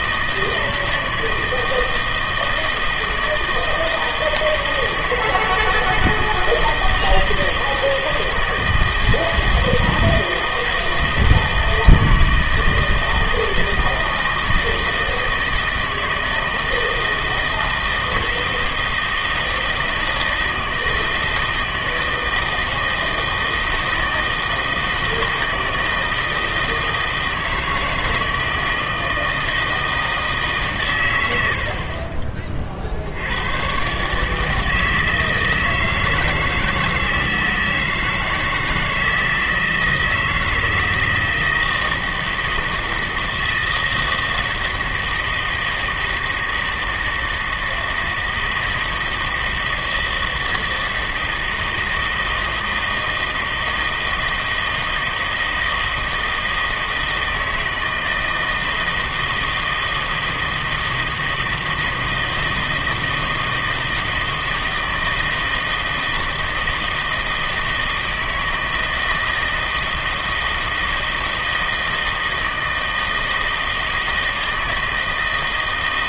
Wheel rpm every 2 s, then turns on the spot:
160, 160, 160, 160, 160, 160, 160, 160, 160, 160, 160, 160, 160, 160, 160, 140, 40, 160, 160, 160, 160, 160, 160, 160, 160, 160, 160, 160, 160, 160, 160, 160, 160, 160, 160, 160, 160, 160.
none